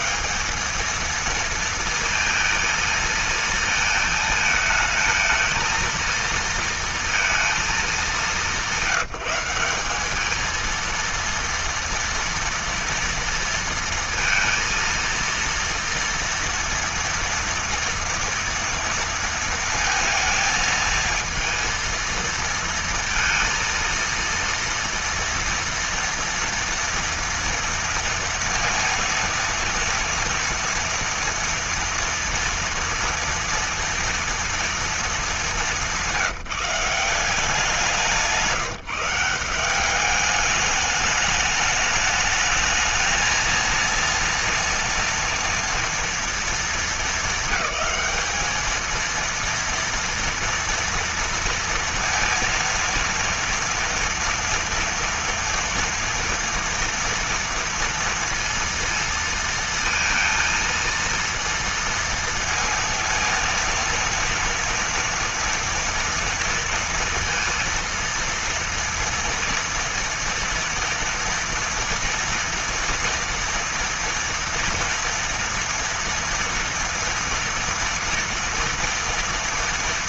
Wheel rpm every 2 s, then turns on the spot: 220, 230, 220, 230, 190, 230, 230, 230, 240, 230, 220, 230, 230, 230, 230, 230, 230, 230, 170, 170, 210, 220, 230, 220, 220, 230, 230, 230, 230, 230, 230, 230, 230, 230, 230, 240, 230, 230, 230, 230.
none